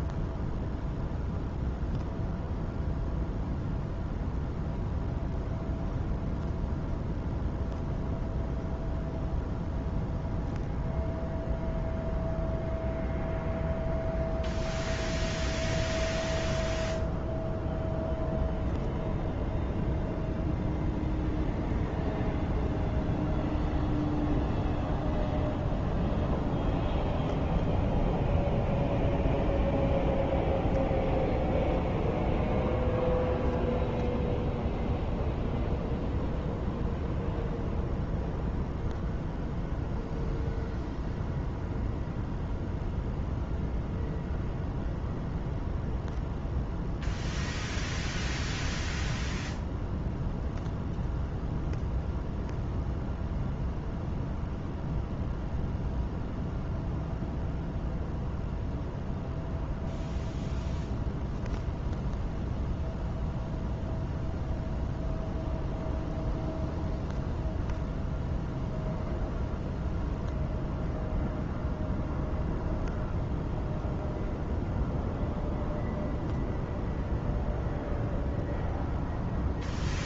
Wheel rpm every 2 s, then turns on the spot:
0, 0, 0, 0, 0, 0, 0, 0, 0, 0, 0, 0, 0, 0, 0, 0, 0, 0, 0, 0, 0, 0, 0, 0, 0, 0, 0, 0, 0, 0, 0, 0, 0, 0, 0, 0, 0, 0, 0, 0.
none